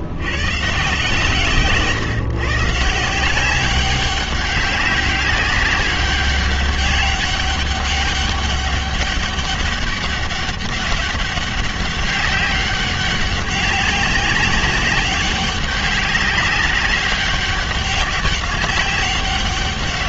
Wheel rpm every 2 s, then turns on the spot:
140, 160, 200, 190, 200, 200, 190, 190, 190, 190.
none